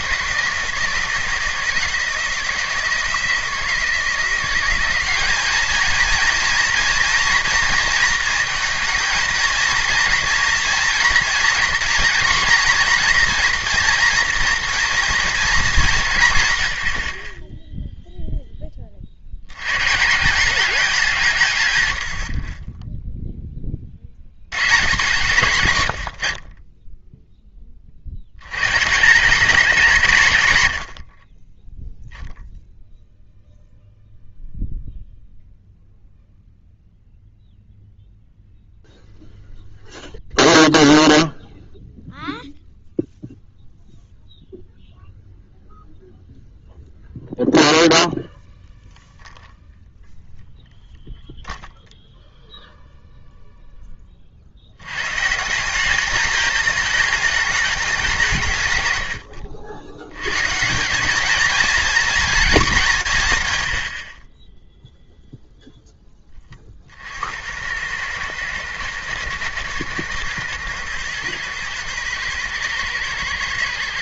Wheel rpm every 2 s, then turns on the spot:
160, 160, 190, 230, 220, 240, 240, 230, 70, 40, 180, 10, 120, 10, 150, 100, 0, 0, 0, 0, 0, 0, 0, 0, 0, 0, 0, 90, 220, 110, 180, 180, 0, 40, 110, 110, 110.
none